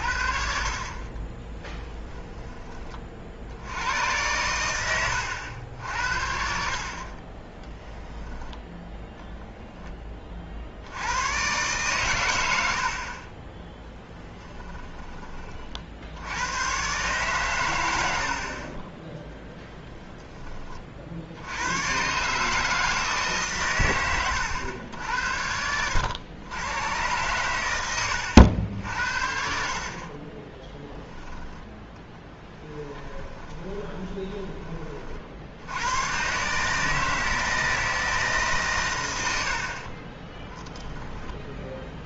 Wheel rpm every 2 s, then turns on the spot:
50, 20, 110, 50, 10, 60, 80, 10, 110, 40, 30, 150, 100, 110, 80, 10, 10, 20, 140, 140, 20.
14-16 18-20 30-34 40-42